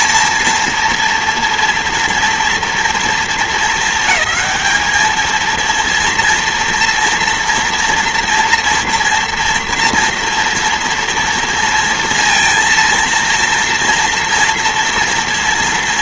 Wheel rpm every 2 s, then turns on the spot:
240, 230, 230, 230, 230, 230, 230, 230.
none